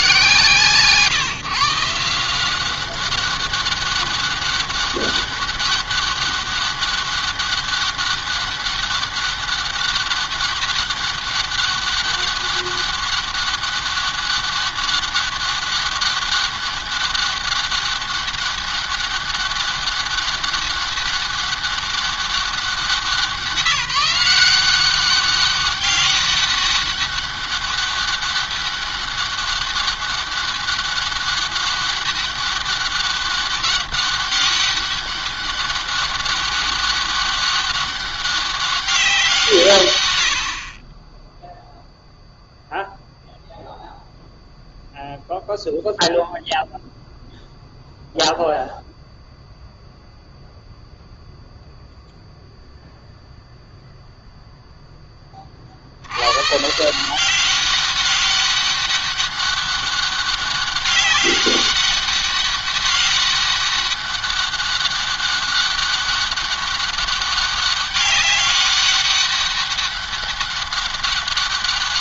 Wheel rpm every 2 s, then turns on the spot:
140, 190, 200, 200, 200, 200, 200, 200, 200, 200, 200, 190, 190, 200, 200, 200, 200, 200, 200, 190, 40, 0, 0, 0, 0, 0, 0, 10, 150, 200, 200, 200, 200, 200, 200, 200.
none